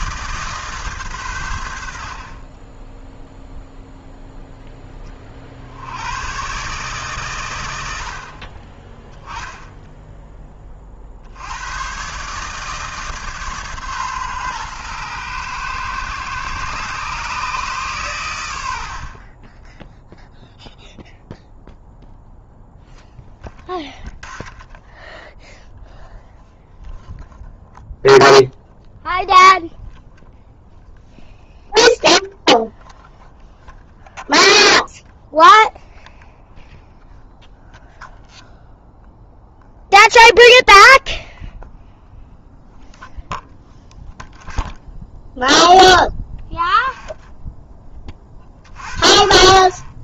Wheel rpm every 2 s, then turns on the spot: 140, 10, 10, 140, 20, 40, 150, 120, 140, 70, 0, 0, 10, 0, 0, 0, 0, 0, 0, 0, 0, 0, 0, 10, 40.
18-20 24-26